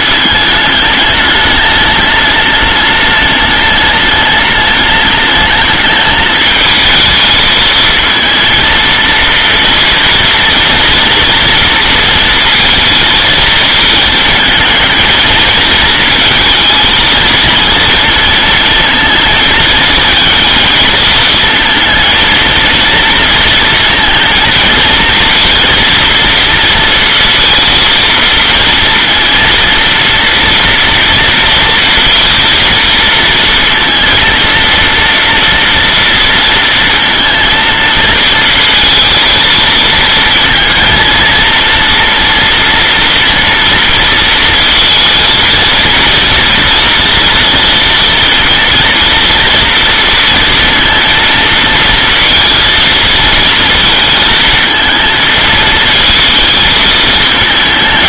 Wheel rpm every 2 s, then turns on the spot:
210, 210, 210, 220, 230, 230, 220, 220, 220, 230, 220, 230, 230, 230, 230, 230, 230, 230, 230, 230, 230, 230, 230, 230, 230, 230, 230, 220, 230.
none